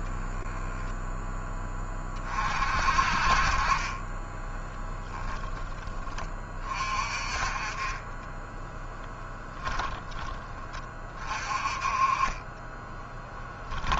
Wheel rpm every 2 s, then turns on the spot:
10, 30, 10, 20, 20, 10, 20.
0-2 4-6 8-10 12-14